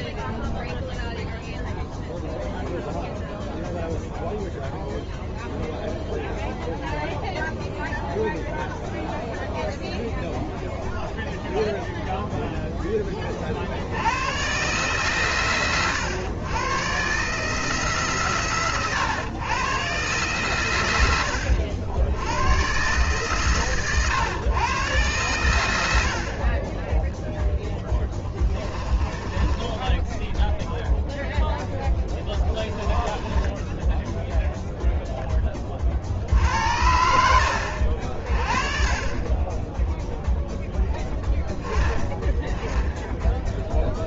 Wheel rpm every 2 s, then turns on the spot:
0, 0, 0, 0, 0, 0, 0, 120, 120, 120, 90, 120, 110, 20, 30, 0, 10, 0, 70, 30, 10, 10.
26-30 32-34